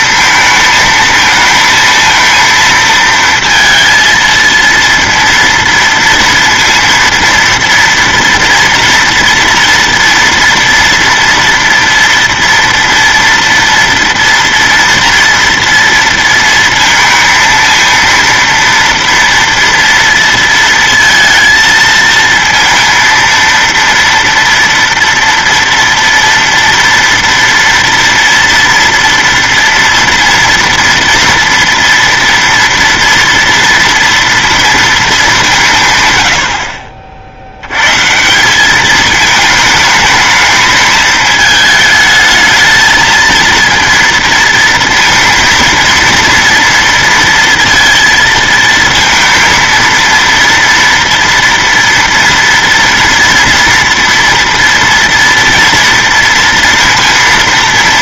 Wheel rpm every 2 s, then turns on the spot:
220, 230, 230, 230, 230, 230, 230, 230, 230, 230, 230, 230, 230, 230, 230, 230, 230, 230, 70, 190, 220, 220, 230, 230, 230, 230, 230, 230, 230.
none